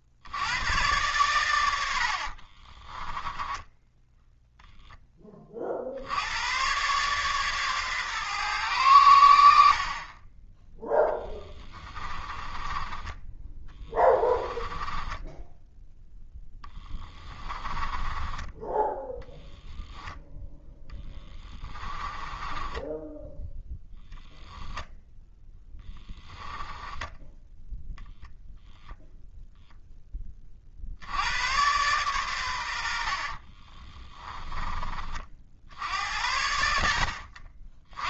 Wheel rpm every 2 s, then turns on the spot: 110, 20, 0, 120, 110, 10, 20, 10, 10, 10, 20, 10, 0, 10, 0, 50, 80, 30, 70.
2-4 12-18 20-24